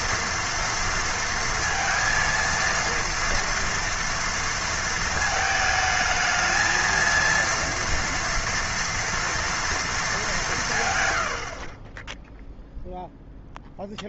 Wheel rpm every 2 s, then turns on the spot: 230, 230, 230, 230, 230, 150, 0.
none